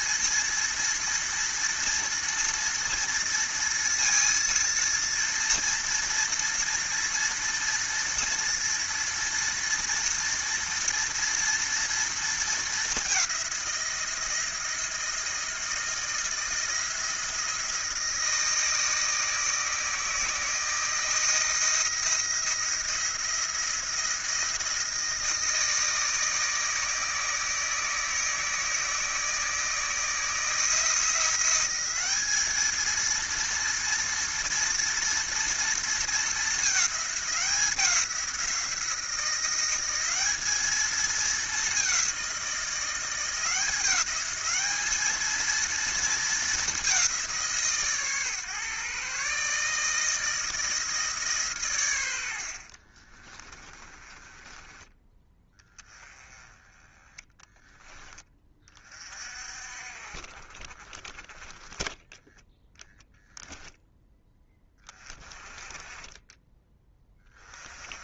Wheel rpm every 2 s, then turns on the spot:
230, 230, 230, 240, 230, 230, 220, 170, 160, 160, 160, 170, 170, 160, 160, 160, 210, 230, 210, 180, 210, 180, 200, 220, 130, 160, 70, 20, 20, 20, 30, 0, 10, 20.
52-56